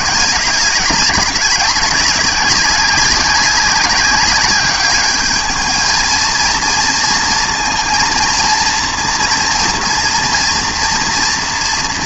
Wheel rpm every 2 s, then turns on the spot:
190, 190, 200, 230, 230, 230.
none